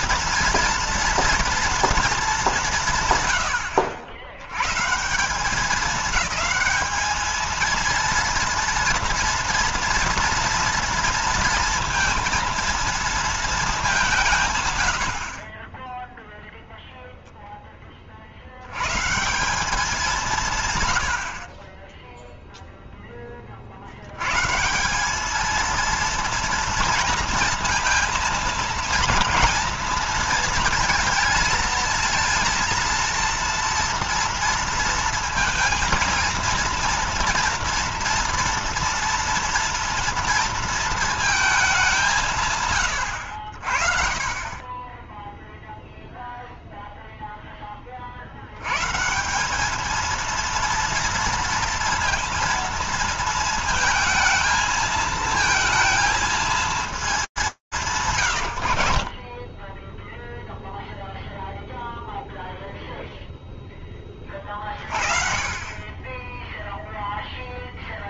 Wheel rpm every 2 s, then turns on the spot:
230, 190, 110, 210, 230, 230, 230, 130, 0, 70, 170, 0, 150, 230, 230, 230, 230, 230, 230, 230, 230, 140, 30, 0, 80, 230, 230, 220, 210, 80, 0, 0, 40, 10.
58-60